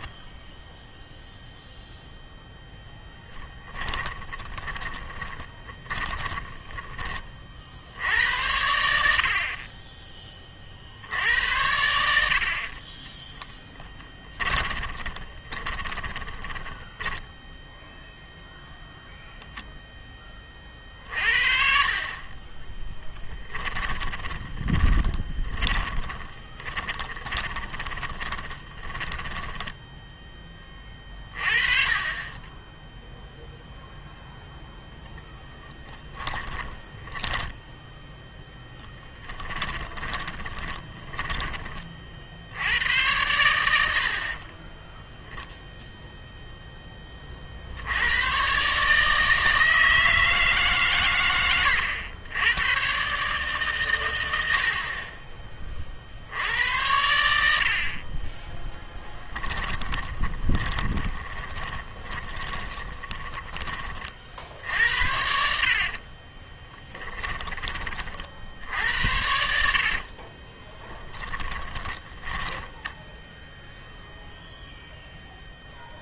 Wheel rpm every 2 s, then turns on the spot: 0, 10, 20, 10, 80, 60, 30, 20, 10, 0, 40, 10, 20, 20, 10, 20, 10, 0, 20, 10, 20, 90, 10, 10, 140, 150, 110, 60, 90, 10, 20, 20, 70, 20, 80, 20, 10, 0.
2-8 12-18 22-30 36-38 40-42 44-46 58-64 66-68 70-74